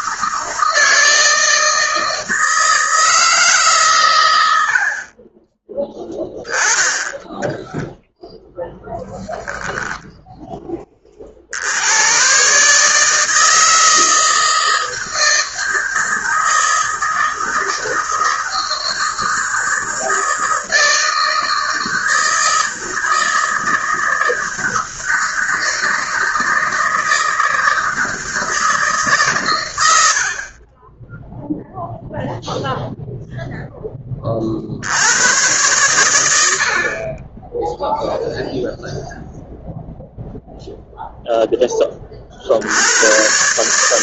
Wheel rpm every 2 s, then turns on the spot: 160, 160, 90, 10, 10, 10, 130, 160, 160, 160, 160, 160, 160, 160, 160, 70, 0, 40, 90, 0, 0, 20.
none